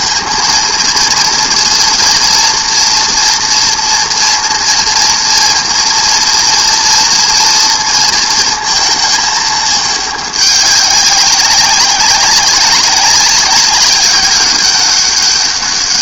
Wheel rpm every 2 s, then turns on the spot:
230, 230, 230, 230, 230, 200, 200, 200.
none